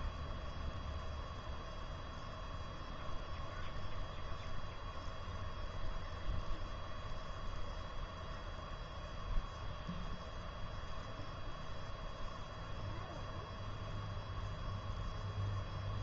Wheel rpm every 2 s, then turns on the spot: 0, 0, 0, 0, 0, 0, 0, 0.
none